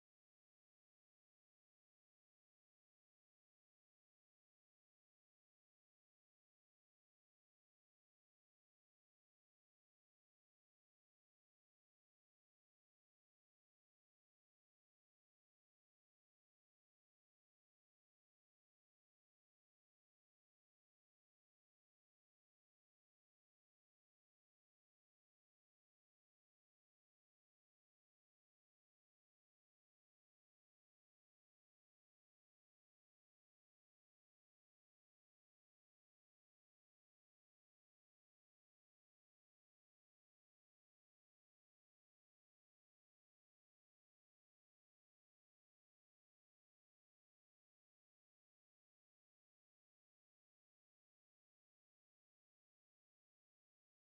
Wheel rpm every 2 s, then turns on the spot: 0, 0, 0, 0, 0, 0, 0, 0, 0, 0, 0, 0, 0, 0, 0, 0, 0, 0, 0, 0, 0, 0, 0, 0, 0, 0, 0.
none